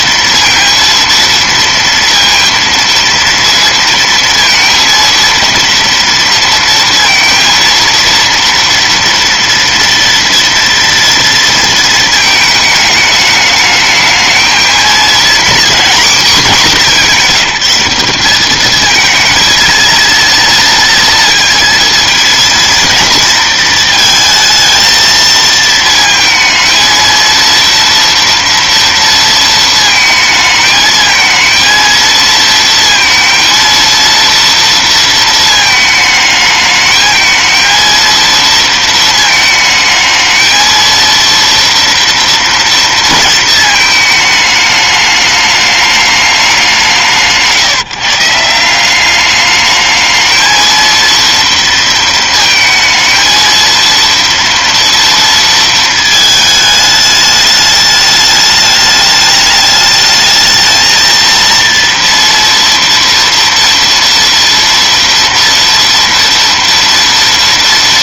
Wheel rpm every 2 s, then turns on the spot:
230, 230, 230, 230, 230, 230, 210, 240, 200, 230, 230, 230, 230, 230, 230, 220, 230, 230, 220, 220, 230, 230, 210, 160, 200, 230, 220, 230, 210, 210, 230, 230, 230, 230.
none